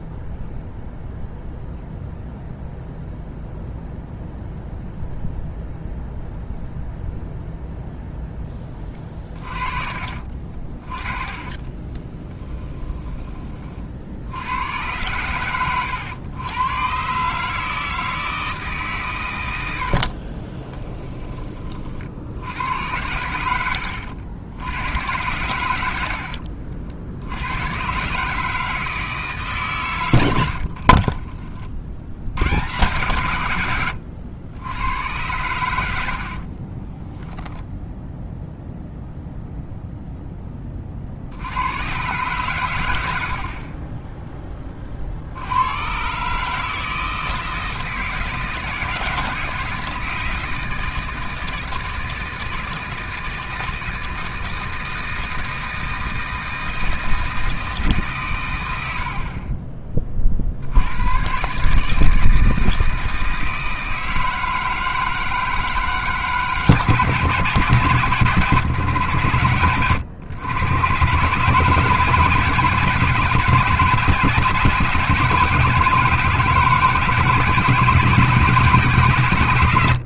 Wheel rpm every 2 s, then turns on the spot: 0, 0, 0, 0, 20, 30, 20, 110, 120, 140, 20, 100, 90, 60, 160, 60, 110, 100, 20, 0, 40, 100, 40, 160, 160, 160, 160, 160, 160, 80, 90, 160, 160, 160, 120, 130, 140, 160, 160, 150.
10-12 20-22 30-32 36-38